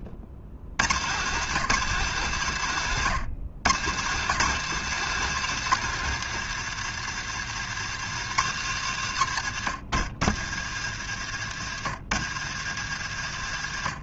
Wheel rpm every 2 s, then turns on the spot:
120, 130, 180, 130, 110, 90, 100.
none